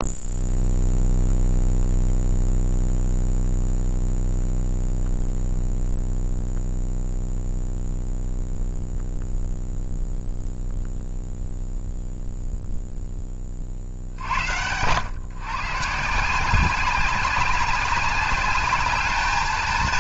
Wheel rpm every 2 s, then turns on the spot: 0, 0, 0, 0, 0, 0, 0, 100, 180, 210.
none